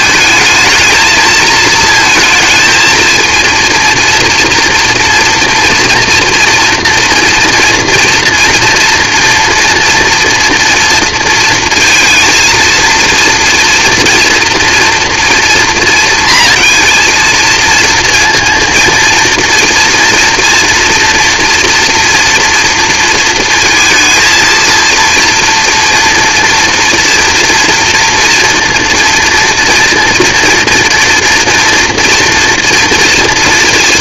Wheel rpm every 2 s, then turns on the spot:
220, 230, 240, 240, 230, 230, 230, 230, 230, 230, 230, 230, 230, 230, 240, 230, 230.
none